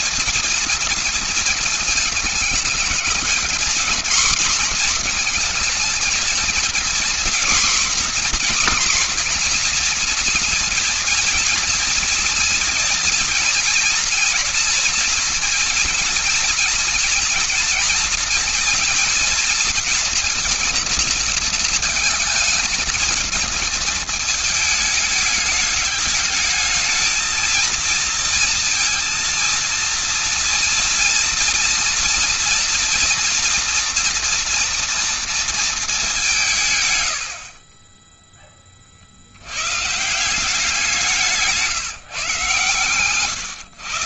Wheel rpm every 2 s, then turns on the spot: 230, 220, 240, 230, 240, 230, 230, 240, 240, 240, 230, 220, 220, 210, 230, 230, 240, 230, 160, 20, 180, 140.
none